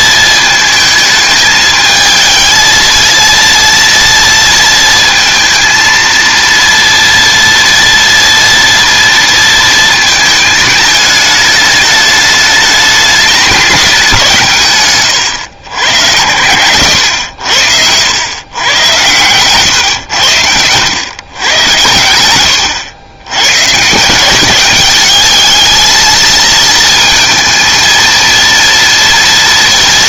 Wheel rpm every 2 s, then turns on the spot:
220, 220, 230, 230, 230, 220, 210, 150, 100, 100, 90, 100, 200, 230, 230.
none